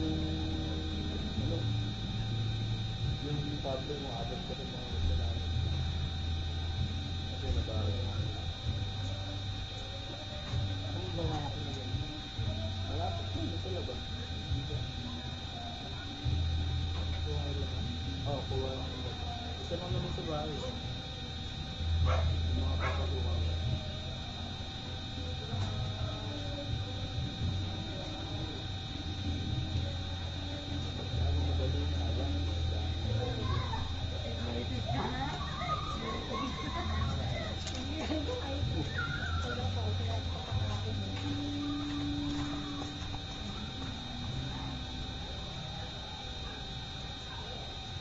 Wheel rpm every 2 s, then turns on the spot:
0, 0, 0, 0, 0, 0, 0, 0, 0, 0, 0, 0, 0, 0, 0, 0, 0, 0, 0, 0, 0, 0, 0, 0.
none